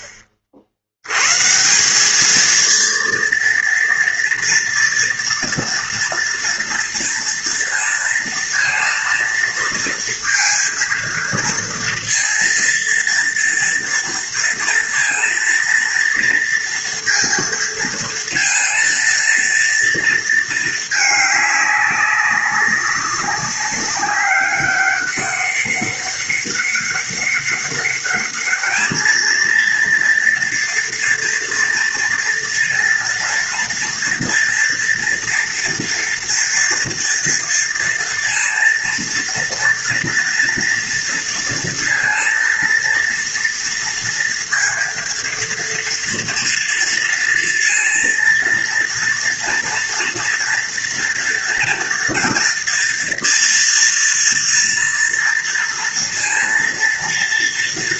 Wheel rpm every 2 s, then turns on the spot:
70, 230, 230, 230, 230, 230, 230, 230, 230, 230, 210, 200, 200, 200, 220, 230, 230, 230, 230, 230, 230, 230, 230, 230, 230, 230, 240, 240, 230.
none